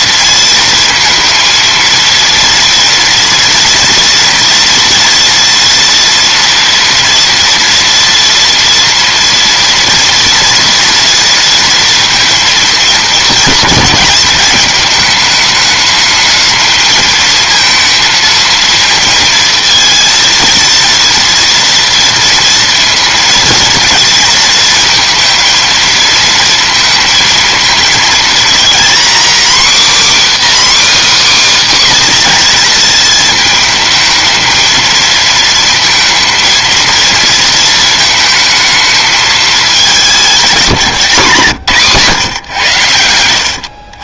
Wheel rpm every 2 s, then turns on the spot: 230, 230, 230, 230, 230, 240, 230, 210, 220, 230, 230, 230, 230, 230, 240, 300, 230, 220, 230, 220, 180, 110.
none